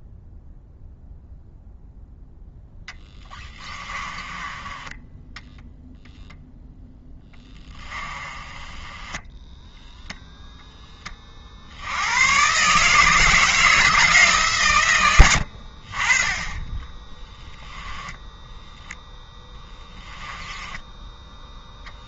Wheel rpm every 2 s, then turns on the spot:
0, 10, 10, 10, 10, 20, 160, 110, 10, 0, 10.
2-4 6-10